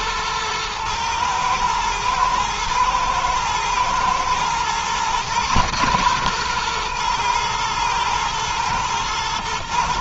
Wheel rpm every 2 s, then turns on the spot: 110, 110, 130, 120, 110.
none